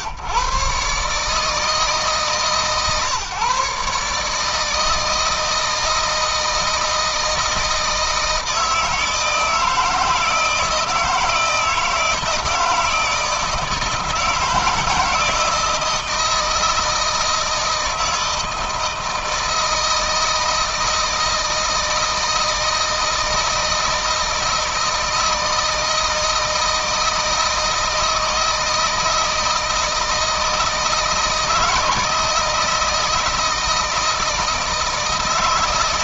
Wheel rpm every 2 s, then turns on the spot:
140, 140, 160, 160, 160, 160, 160, 160, 160, 160, 160, 160, 160, 160, 160, 160, 160, 160.
none